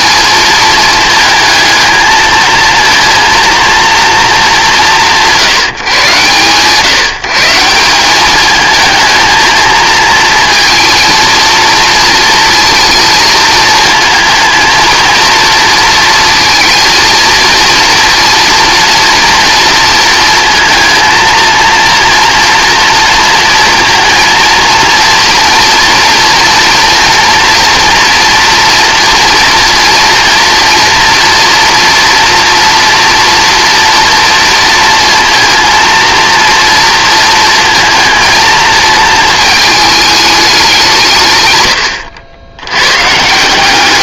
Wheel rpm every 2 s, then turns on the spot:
220, 220, 190, 150, 220, 230, 230, 230, 230, 230, 230, 230, 230, 230, 240, 240, 230, 230, 230, 220, 180, 100.
none